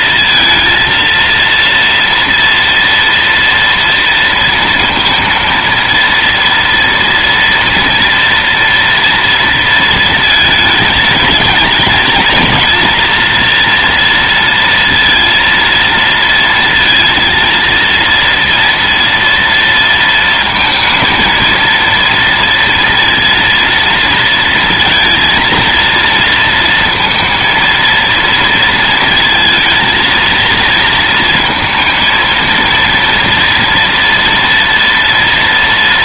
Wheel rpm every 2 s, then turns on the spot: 230, 230, 230, 230, 230, 220, 230, 230, 230, 230, 230, 230, 230, 230, 230, 230, 230, 240.
none